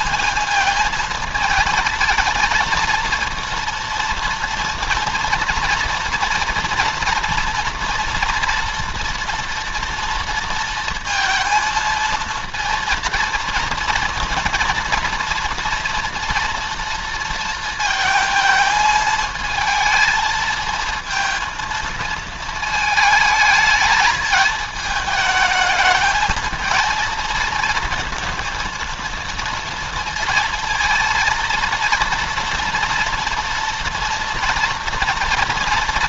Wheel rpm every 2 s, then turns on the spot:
220, 230, 230, 230, 230, 220, 230, 230, 230, 220, 220, 220, 220, 220, 230, 230, 230, 230.
none